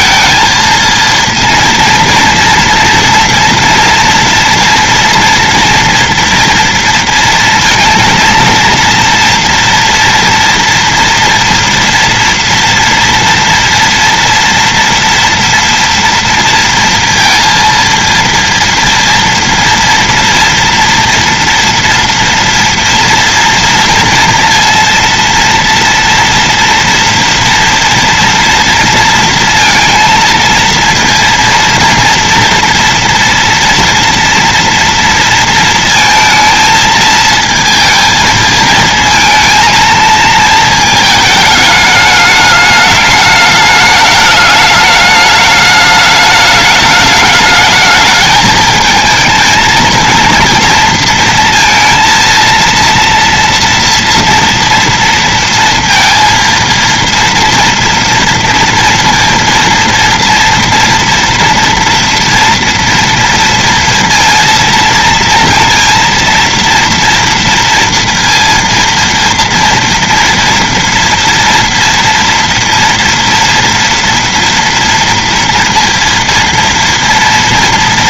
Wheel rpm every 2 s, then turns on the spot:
230, 230, 230, 230, 230, 230, 230, 230, 230, 230, 230, 230, 230, 240, 230, 230, 230, 230, 220, 220, 220, 210, 210, 210, 220, 230, 230, 230, 230, 230, 230, 230, 230, 230, 230, 230, 240, 230, 230.
none